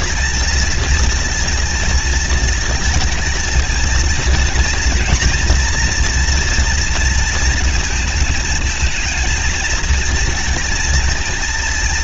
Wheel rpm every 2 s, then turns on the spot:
220, 220, 230, 230, 220, 230.
none